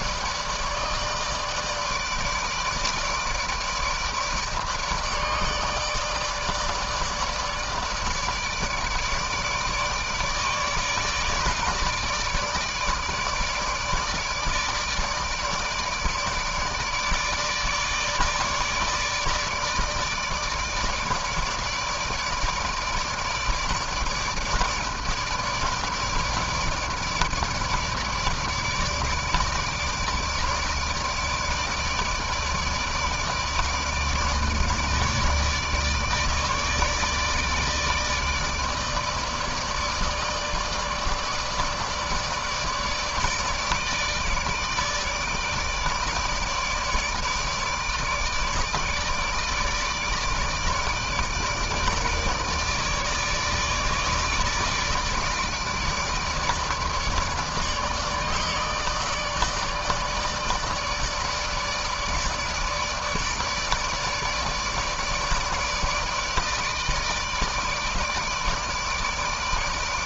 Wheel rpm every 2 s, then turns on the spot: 150, 160, 150, 150, 150, 150, 160, 150, 150, 150, 160, 150, 160, 160, 160, 160, 150, 150, 150, 160, 150, 160, 150, 150, 150, 150, 150, 150, 150, 150, 150, 150, 150, 150, 150.
none